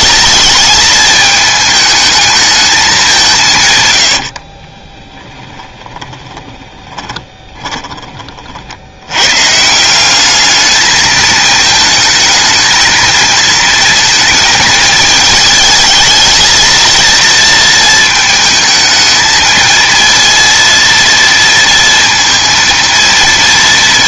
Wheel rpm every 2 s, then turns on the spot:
220, 210, 20, 20, 70, 220, 220, 220, 230, 220, 230, 230.
4-8